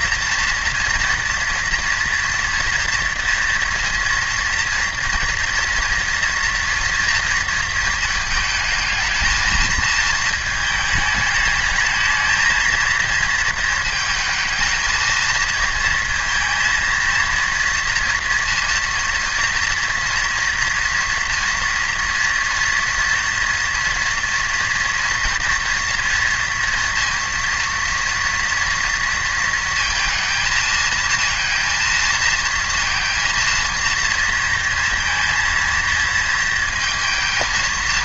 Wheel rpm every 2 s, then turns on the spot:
230, 230, 230, 230, 220, 220, 220, 220, 230, 230, 230, 240, 230, 230, 230, 220, 230, 230, 230.
none